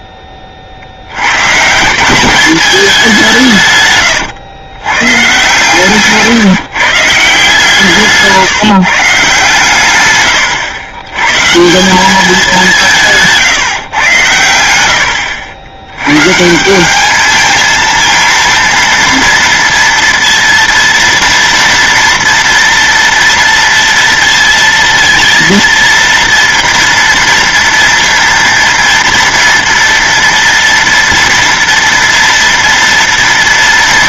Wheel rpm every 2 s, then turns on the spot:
40, 210, 110, 140, 160, 110, 180, 90, 160, 230, 230, 230, 230, 240, 230, 230, 230.
none